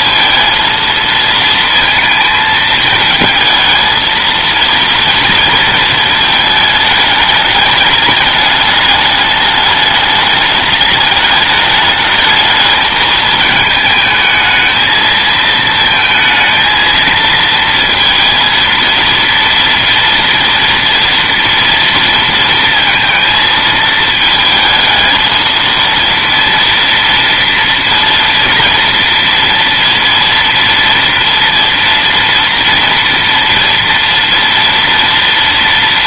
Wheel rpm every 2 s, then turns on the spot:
230, 220, 230, 210, 210, 210, 220, 220, 230, 230, 230, 230, 220, 230, 230, 230, 230, 230.
none